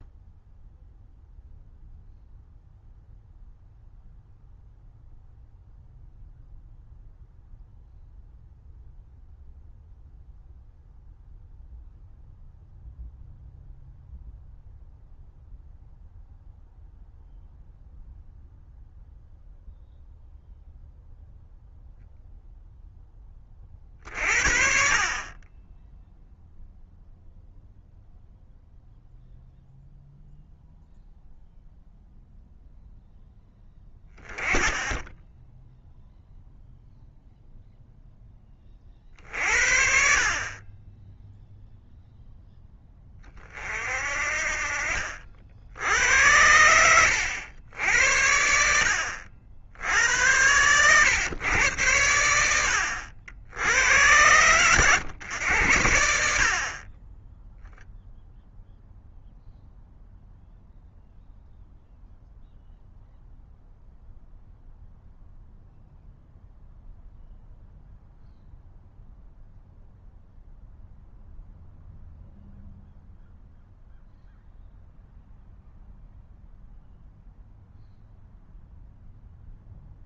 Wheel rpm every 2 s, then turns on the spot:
0, 0, 0, 0, 0, 0, 0, 0, 0, 0, 0, 0, 50, 0, 0, 0, 0, 10, 0, 30, 30, 10, 50, 90, 70, 100, 80, 110, 50, 0, 0, 0, 0, 0, 0, 0, 0, 0, 0, 0.
none